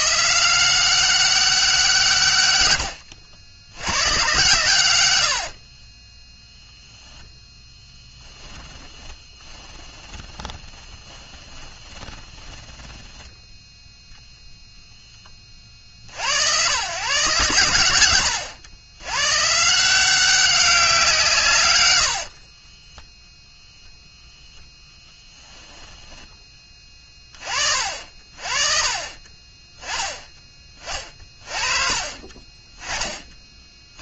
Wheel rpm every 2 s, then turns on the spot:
180, 100, 100, 0, 10, 20, 10, 0, 120, 100, 180, 20, 0, 20, 40, 30, 20.
8-14 22-24